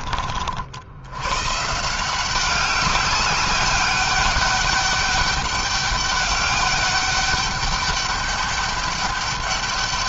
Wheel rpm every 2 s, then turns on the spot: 70, 200, 200, 200, 200.
none